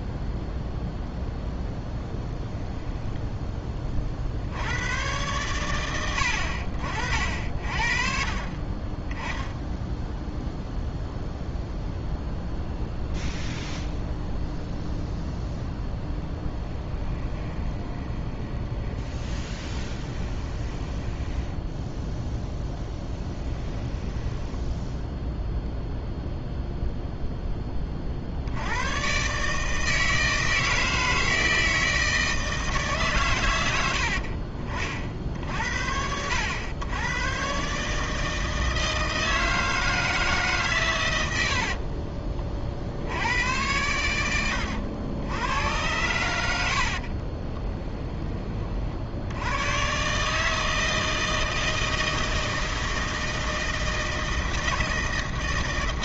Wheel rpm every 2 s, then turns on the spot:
0, 20, 100, 60, 30, 0, 0, 0, 10, 20, 20, 10, 0, 0, 110, 160, 140, 30, 110, 160, 130, 70, 90, 60, 60, 160, 160, 160.
2-4 16-22 46-48